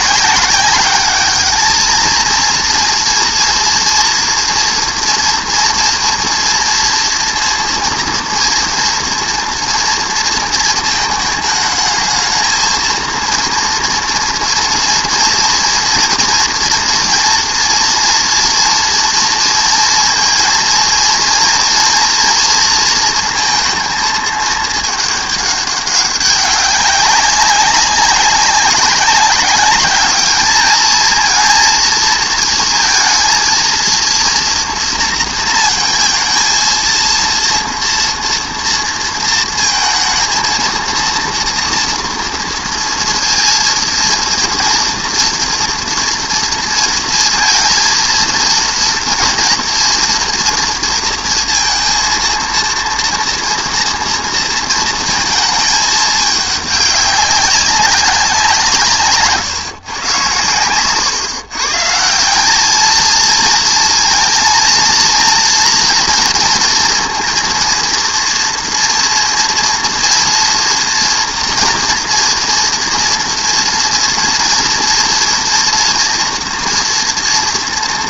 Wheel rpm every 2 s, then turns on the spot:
200, 230, 240, 240, 230, 220, 220, 230, 230, 230, 230, 230, 220, 200, 200, 220, 230, 230, 230, 230, 230, 230, 230, 230, 230, 230, 230, 230, 200, 170, 110, 210, 230, 230, 230, 240, 230, 230, 240.
none